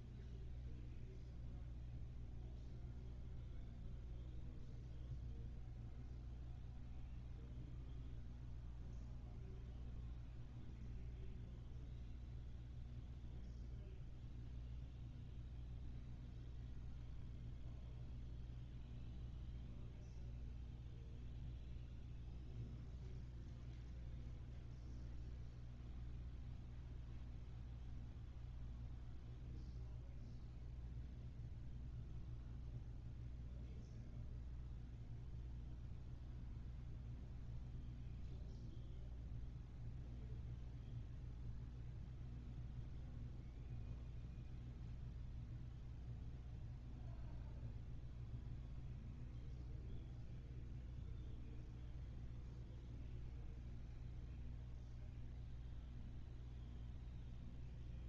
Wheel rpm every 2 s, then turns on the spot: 0, 0, 0, 0, 0, 0, 0, 0, 0, 0, 0, 0, 0, 0, 0, 0, 0, 0, 0, 0, 0, 0, 0, 0, 0, 0, 0, 0, 0.
none